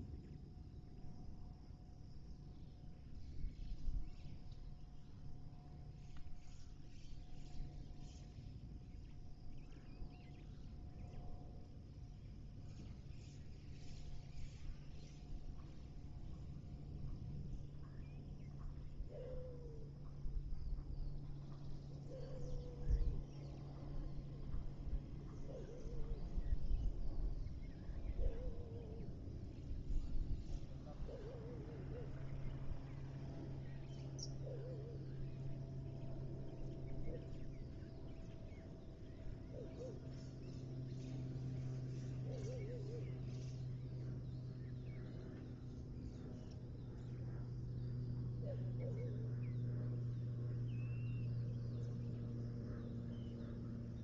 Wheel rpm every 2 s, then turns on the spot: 0, 0, 0, 0, 0, 0, 0, 0, 0, 0, 0, 0, 0, 0, 0, 0, 0, 0, 0, 0, 0, 0, 0, 0, 0, 0, 0.
none